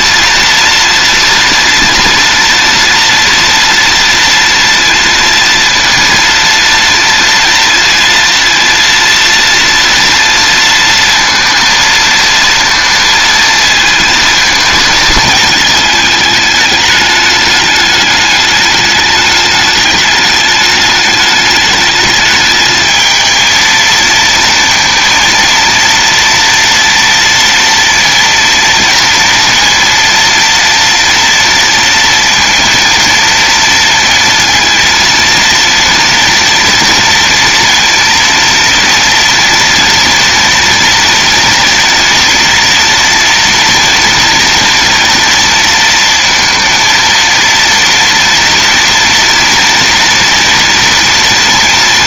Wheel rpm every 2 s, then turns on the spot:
240, 230, 230, 230, 230, 230, 230, 220, 210, 210, 210, 220, 230, 230, 230, 230, 230, 230, 230, 230, 230, 230, 240, 230, 240, 240.
none